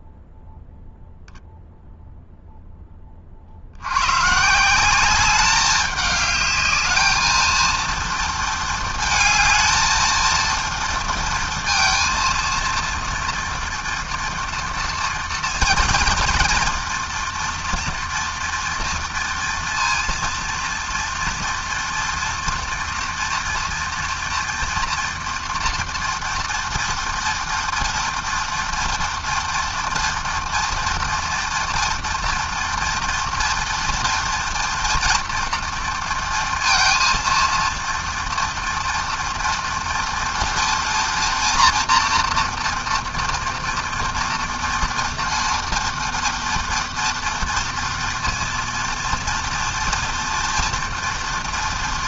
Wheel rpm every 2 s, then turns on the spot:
0, 50, 200, 220, 220, 230, 230, 240, 240, 230, 230, 230, 230, 230, 230, 230, 240, 240, 230, 230, 230, 230, 230, 230, 230, 240.
none